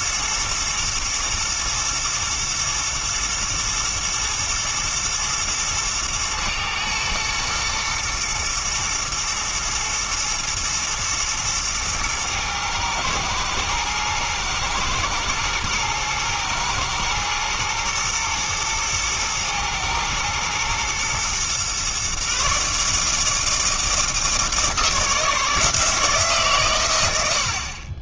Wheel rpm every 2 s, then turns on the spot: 120, 120, 120, 110, 120, 120, 110, 110, 110, 110, 120, 140, 160, 130.
none